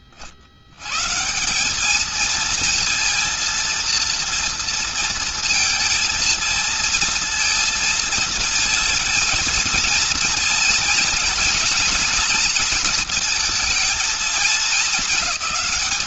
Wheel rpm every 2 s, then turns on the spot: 40, 220, 230, 230, 230, 230, 230, 220.
none